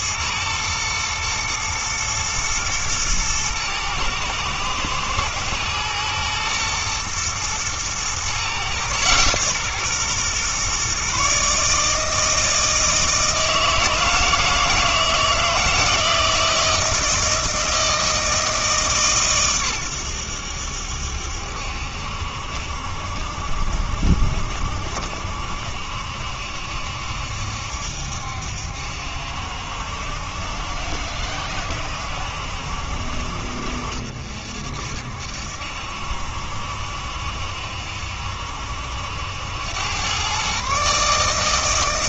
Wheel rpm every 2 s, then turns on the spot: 110, 110, 110, 120, 130, 130, 160, 160, 160, 150, 80, 60, 70, 70, 70, 70, 60, 60, 70, 70, 130.
none